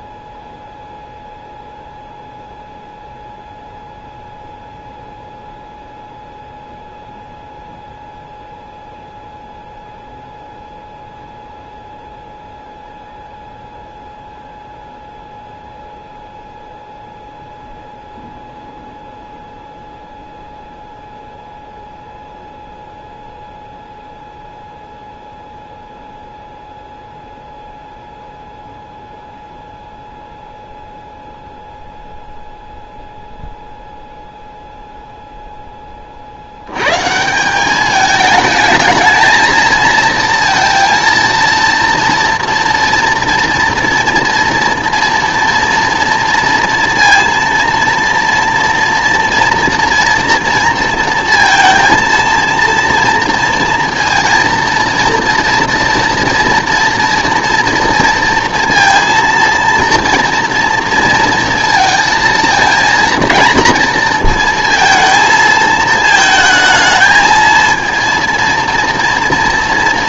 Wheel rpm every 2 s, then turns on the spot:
0, 0, 0, 0, 0, 0, 0, 0, 0, 0, 0, 0, 0, 0, 0, 0, 0, 0, 90, 220, 230, 230, 230, 230, 240, 230, 230, 230, 240, 230, 230, 230, 230, 220, 230.
none